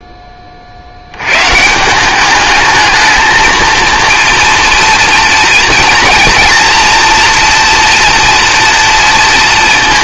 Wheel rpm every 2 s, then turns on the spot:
50, 210, 230, 230, 230.
none